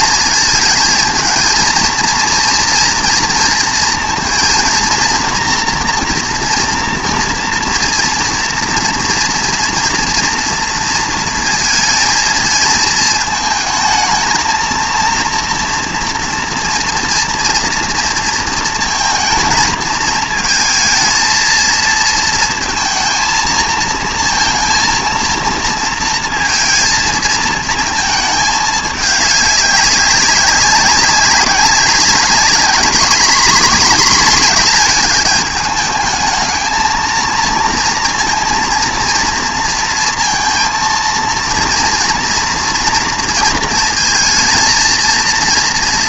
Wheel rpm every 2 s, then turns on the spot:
230, 230, 230, 230, 230, 230, 220, 230, 230, 230, 230, 230, 230, 220, 210, 190, 220, 230, 220, 230, 230, 230, 220.
none